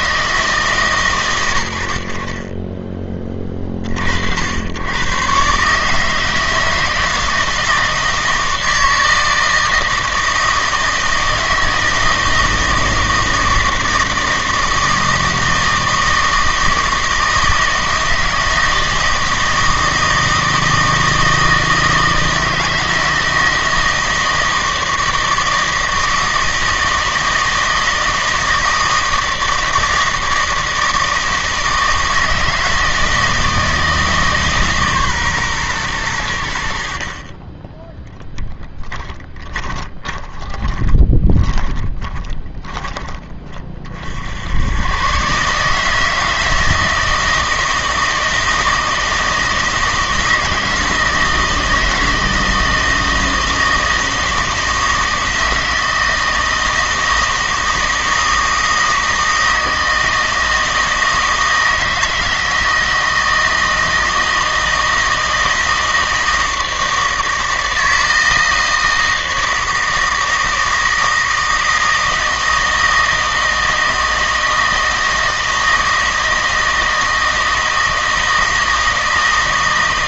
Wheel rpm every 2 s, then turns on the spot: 130, 20, 100, 160, 160, 160, 160, 160, 160, 160, 160, 160, 160, 160, 160, 160, 160, 140, 60, 10, 10, 20, 100, 160, 160, 160, 160, 160, 160, 160, 160, 160, 160, 160, 160, 160, 160, 160, 160, 160.
38-44